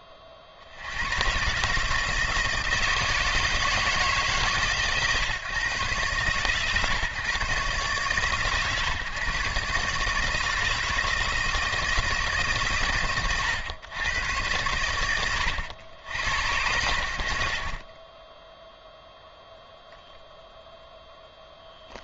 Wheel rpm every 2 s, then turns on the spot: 60, 160, 150, 130, 130, 160, 120, 80, 100, 0, 0.
none